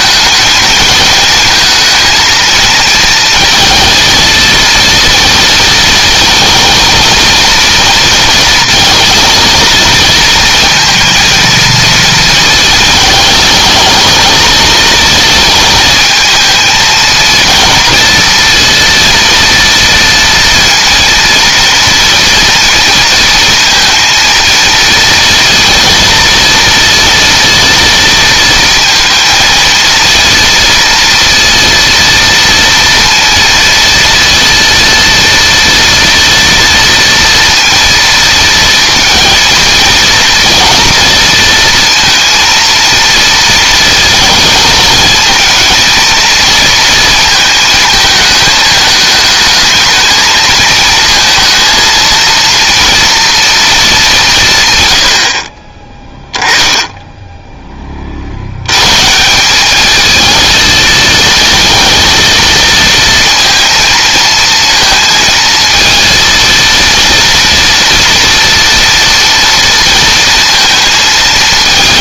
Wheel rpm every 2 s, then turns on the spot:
220, 230, 230, 230, 230, 230, 230, 230, 230, 230, 230, 230, 230, 230, 230, 230, 230, 230, 230, 230, 230, 230, 220, 230, 210, 220, 230, 120, 10, 110, 220, 230, 230, 230, 230, 220.
none